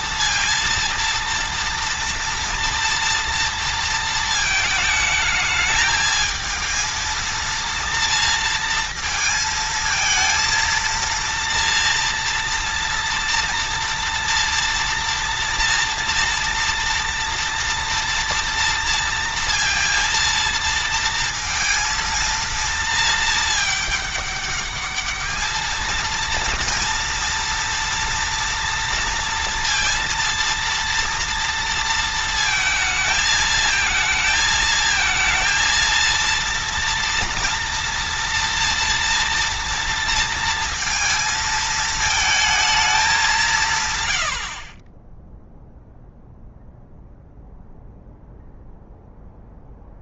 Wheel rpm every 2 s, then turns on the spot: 230, 230, 220, 220, 230, 230, 230, 230, 230, 230, 230, 220, 210, 230, 230, 230, 220, 220, 230, 230, 230, 210, 30, 0, 0.
none